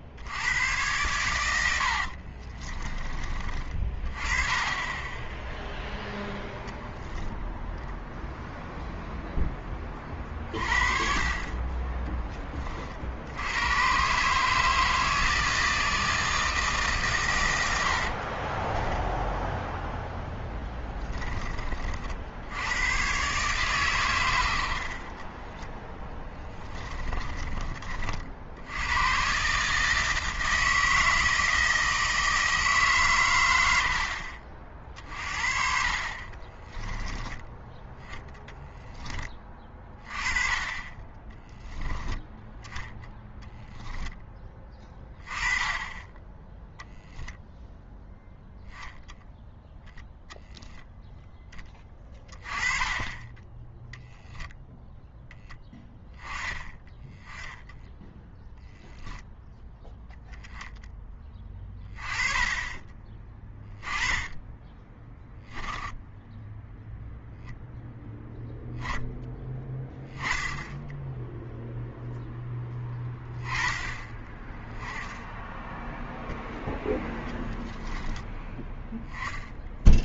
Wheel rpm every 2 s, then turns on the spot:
100, 30, 20, 0, 0, 40, 30, 160, 150, 20, 10, 90, 70, 20, 80, 160, 150, 40, 20, 10, 20, 0, 20, 10, 10, 0, 20, 0, 10, 0, 10, 20, 10, 0, 0, 0, 10, 10, 0, 10.
2-4 18-22 26-28 36-38